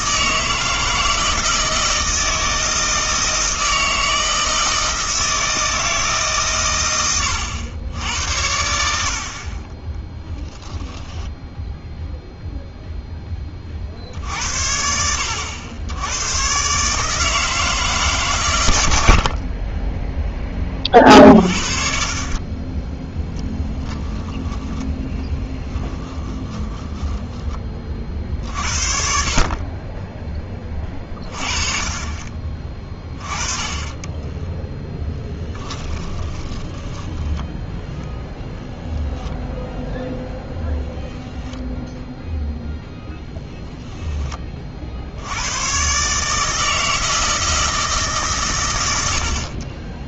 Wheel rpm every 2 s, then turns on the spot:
160, 160, 160, 120, 70, 30, 0, 60, 130, 110, 30, 20, 10, 10, 50, 20, 20, 10, 10, 0, 0, 0, 30, 160, 130.
10-12 24-26 34-38